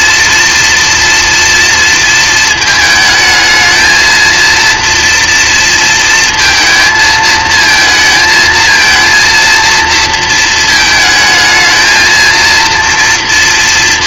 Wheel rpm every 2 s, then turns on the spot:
230, 220, 230, 220, 220, 220, 230.
none